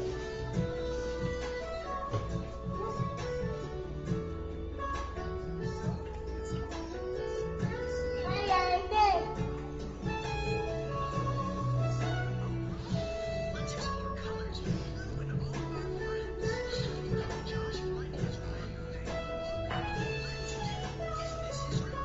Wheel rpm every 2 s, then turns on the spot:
0, 0, 0, 0, 0, 0, 0, 0, 0, 0, 0.
none